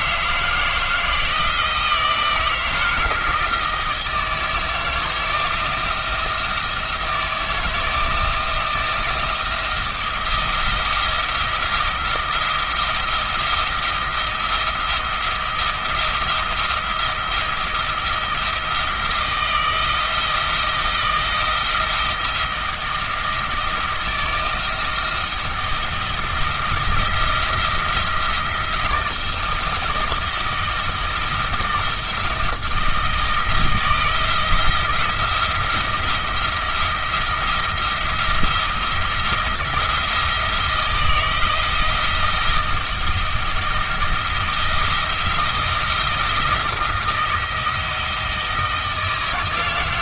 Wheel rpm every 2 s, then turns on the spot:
160, 160, 160, 160, 170, 170, 170, 170, 170, 170, 170, 160, 160, 170, 170, 170, 170, 170, 170, 170, 170, 170, 170, 170, 170.
none